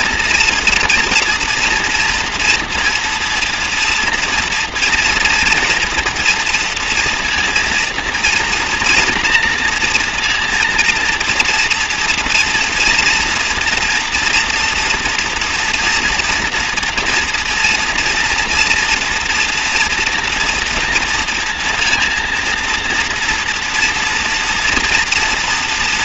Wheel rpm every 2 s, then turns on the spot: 230, 230, 230, 230, 240, 230, 240, 240, 230, 230, 240, 230, 230.
none